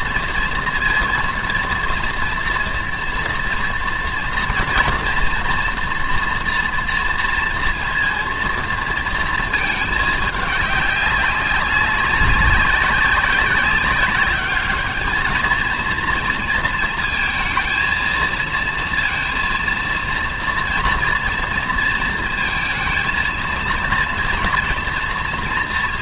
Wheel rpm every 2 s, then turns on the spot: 230, 240, 240, 230, 230, 200, 190, 220, 230, 230, 230, 220, 230.
none